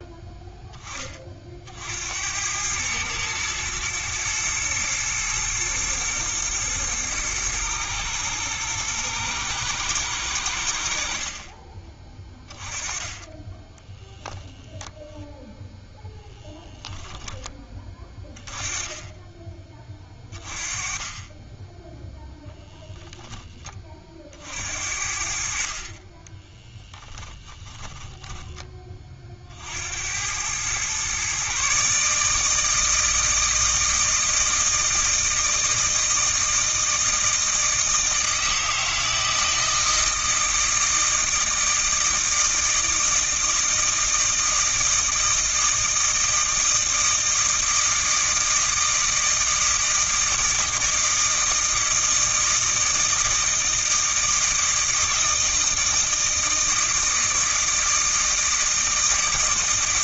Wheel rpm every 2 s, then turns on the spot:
20, 110, 110, 110, 110, 60, 20, 0, 10, 20, 30, 0, 60, 10, 30, 120, 160, 160, 160, 160, 160, 160, 160, 160, 160, 160, 160, 160, 160, 160.
26-28